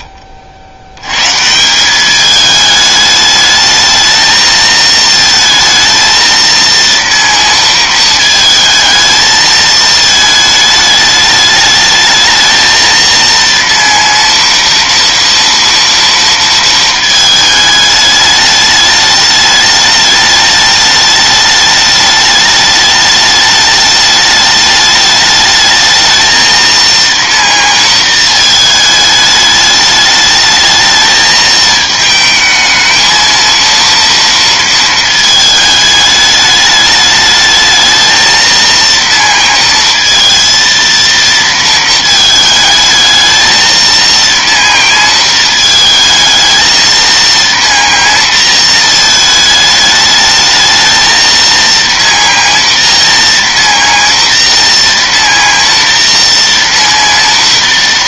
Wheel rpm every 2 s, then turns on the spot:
60, 210, 220, 230, 220, 220, 220, 230, 230, 210, 210, 210, 210, 230, 220, 220, 220, 230, 210, 230, 230, 220, 230, 220, 230, 220, 230, 230, 240.
none